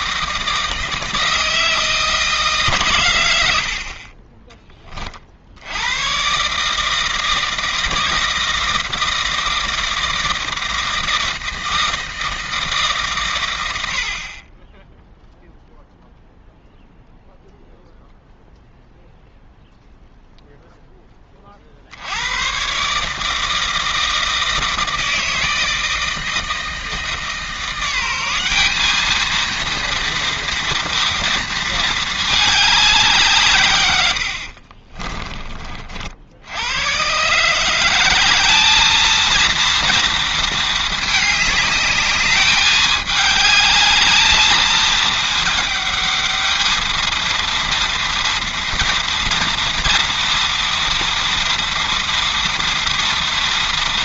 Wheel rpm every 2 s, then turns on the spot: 160, 140, 20, 150, 160, 160, 150, 10, 0, 0, 0, 130, 160, 160, 200, 230, 200, 50, 100, 210, 220, 210, 220, 220, 230, 230, 230.
34-36